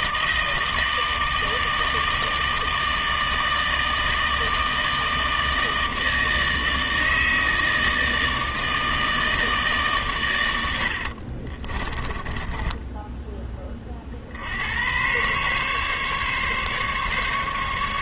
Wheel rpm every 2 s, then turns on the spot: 160, 160, 160, 160, 160, 80, 10, 110, 140.
10-14